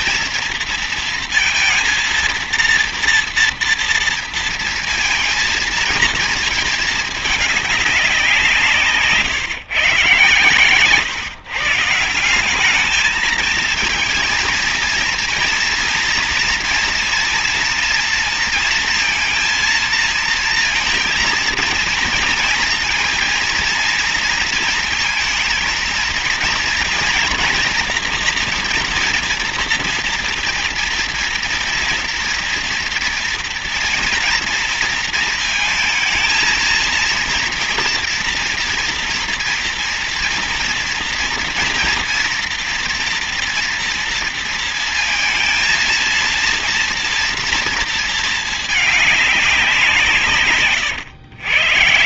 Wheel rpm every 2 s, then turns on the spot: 230, 230, 230, 230, 180, 130, 190, 230, 230, 230, 230, 230, 230, 230, 240, 230, 230, 230, 230, 240, 230, 240, 230, 230, 220, 140.
50-52